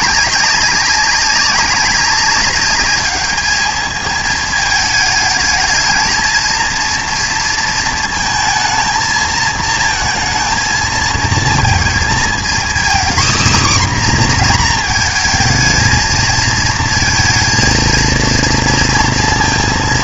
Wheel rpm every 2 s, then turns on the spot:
200, 200, 220, 230, 220, 230, 250, 240, 220, 230.
none